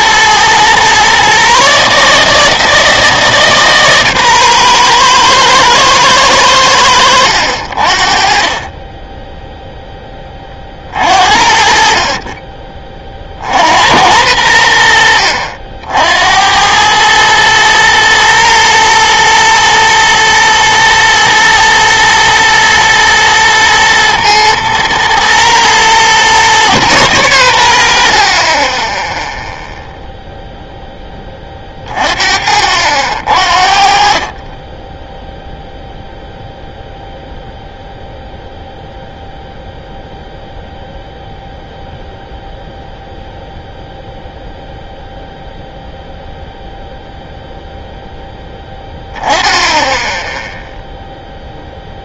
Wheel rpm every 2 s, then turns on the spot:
120, 160, 120, 100, 30, 30, 20, 90, 90, 110, 120, 110, 110, 130, 30, 0, 60, 20, 0, 0, 0, 0, 0, 0, 10, 0.
none